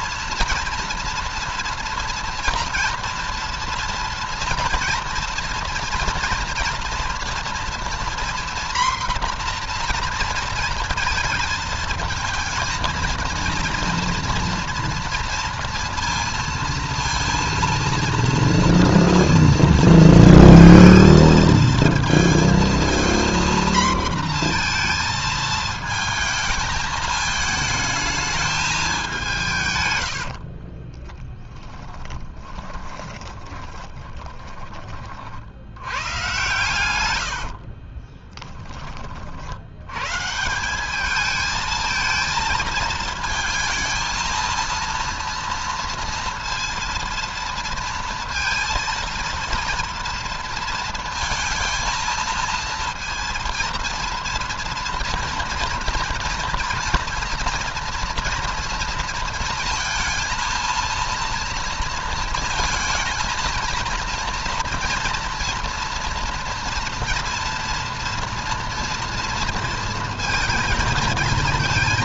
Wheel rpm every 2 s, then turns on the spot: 230, 230, 230, 240, 240, 230, 230, 230, 230, 230, 230, 230, 230, 220, 200, 40, 20, 30, 90, 30, 200, 220, 230, 230, 230, 230, 230, 230, 230, 230, 230, 230, 230, 230, 230, 230.
30-34 36-38